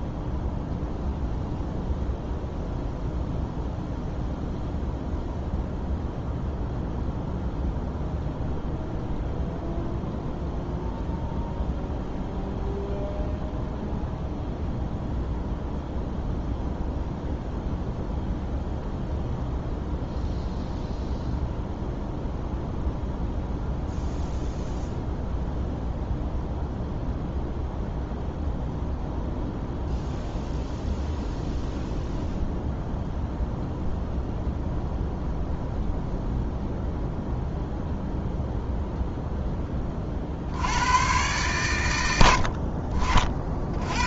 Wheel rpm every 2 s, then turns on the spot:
0, 0, 0, 0, 0, 0, 0, 0, 0, 0, 0, 0, 0, 0, 0, 0, 0, 0, 0, 10, 120, 40.
none